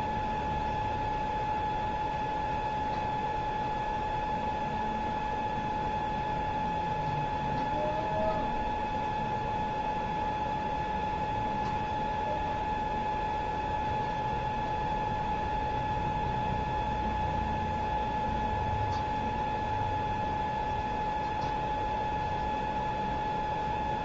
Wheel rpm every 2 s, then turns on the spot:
0, 0, 0, 0, 0, 0, 0, 0, 0, 0, 0, 0.
none